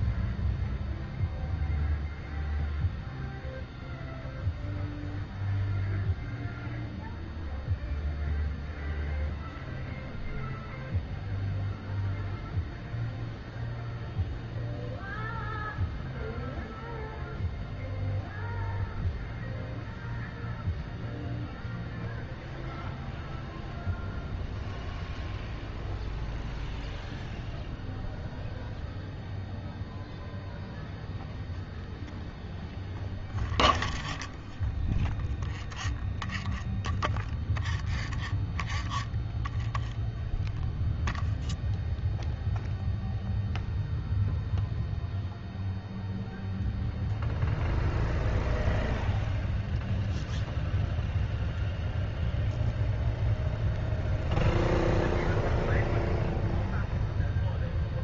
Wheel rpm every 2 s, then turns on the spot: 0, 0, 0, 0, 0, 0, 0, 0, 0, 0, 0, 0, 0, 0, 0, 0, 0, 10, 10, 10, 0, 0, 0, 0, 0, 0, 0, 0, 0.
none